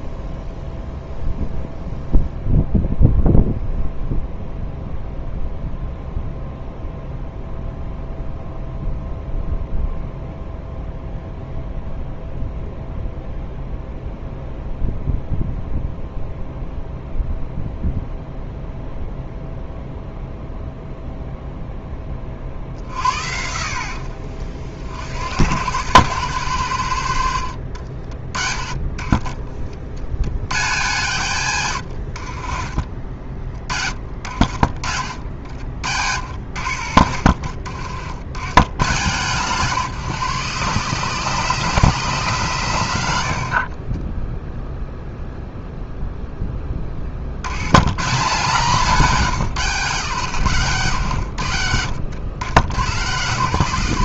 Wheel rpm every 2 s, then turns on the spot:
0, 0, 0, 0, 0, 0, 0, 0, 0, 0, 0, 60, 50, 100, 30, 130, 40, 60, 70, 110, 150, 130, 0, 30, 160, 130, 100.
none